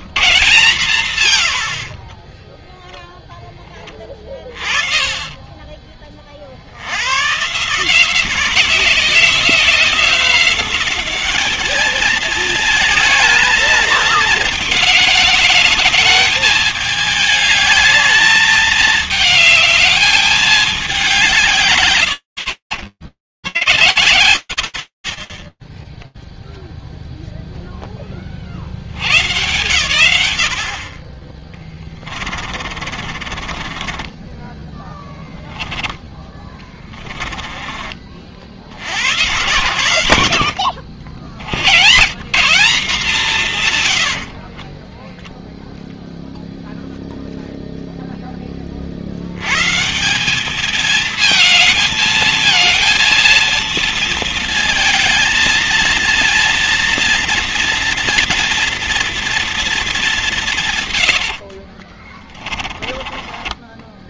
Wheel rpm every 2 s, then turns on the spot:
160, 10, 20, 80, 180, 190, 220, 210, 210, 210, 190, 90, 30, 10, 120, 30, 30, 20, 50, 100, 150, 50, 0, 0, 180, 220, 220, 220, 230, 170, 30, 20.
2-4 30-36 38-40 42-44 60-64